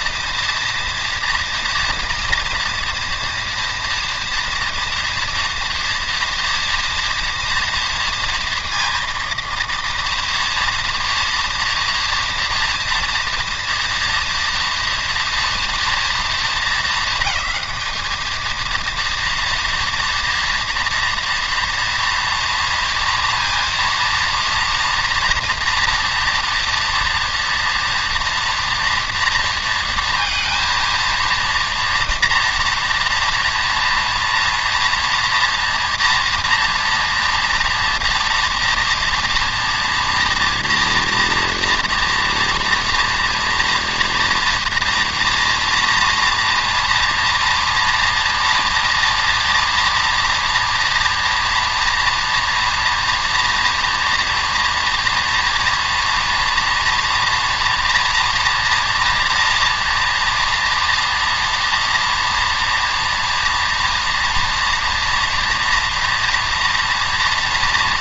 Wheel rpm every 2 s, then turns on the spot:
230, 230, 240, 230, 230, 230, 230, 230, 220, 230, 230, 230, 230, 240, 230, 230, 230, 230, 240, 230, 230, 230, 230, 230, 230, 230, 230, 230, 230, 230, 230, 230, 240, 230.
none